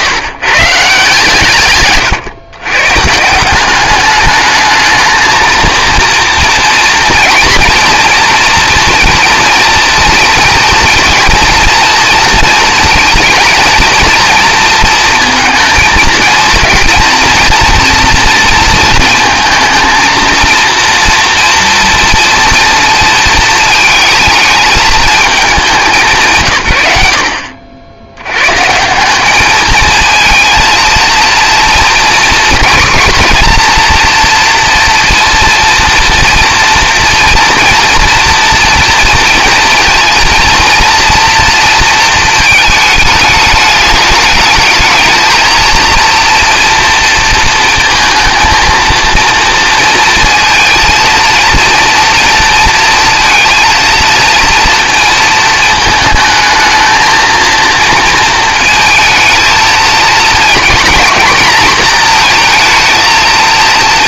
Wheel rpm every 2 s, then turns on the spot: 150, 130, 220, 230, 240, 230, 230, 230, 230, 230, 230, 230, 220, 120, 140, 230, 230, 230, 230, 230, 230, 220, 220, 230, 230, 230, 230, 230, 220, 220, 230, 230.
none